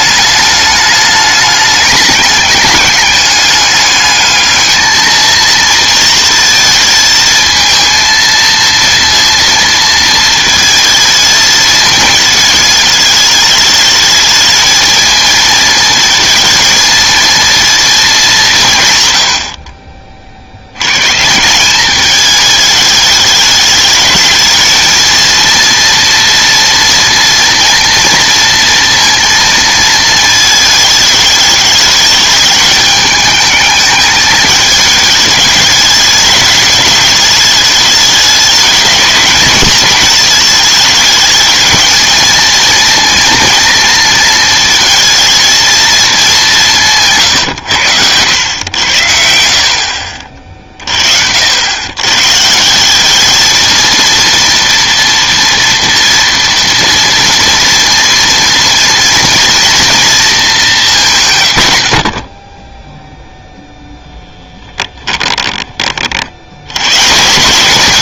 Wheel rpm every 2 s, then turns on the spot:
210, 200, 220, 230, 230, 220, 220, 220, 220, 150, 80, 210, 220, 240, 230, 220, 210, 220, 210, 210, 210, 230, 230, 180, 90, 40, 170, 230, 230, 230, 200, 10, 10, 110.
64-66